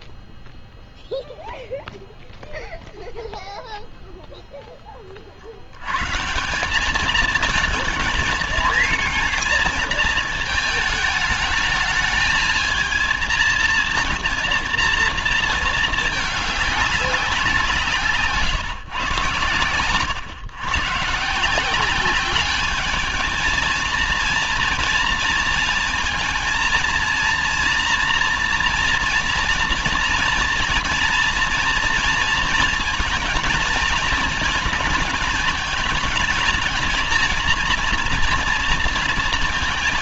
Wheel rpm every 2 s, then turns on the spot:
0, 0, 10, 180, 230, 220, 220, 230, 210, 150, 130, 210, 230, 230, 230, 230, 230, 210, 220, 230.
none